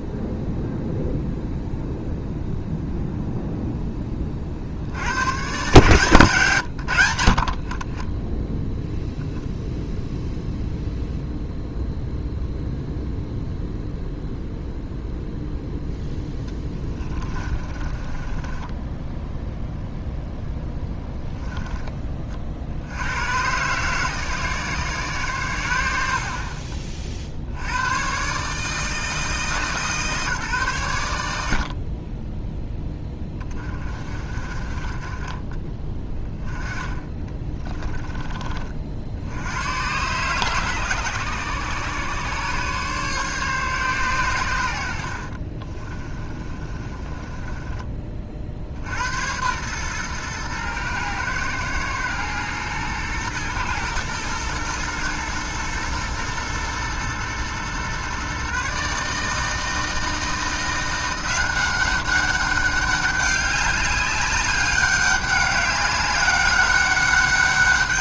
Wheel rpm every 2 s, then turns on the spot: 0, 0, 50, 130, 10, 0, 0, 0, 10, 10, 0, 50, 130, 40, 150, 130, 10, 30, 10, 50, 140, 130, 100, 30, 60, 110, 120, 110, 120, 140, 170, 200, 200, 200.
16-20 46-48